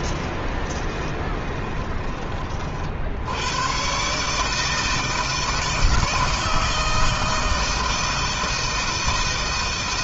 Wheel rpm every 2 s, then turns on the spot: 20, 60, 160, 160, 160.
0-2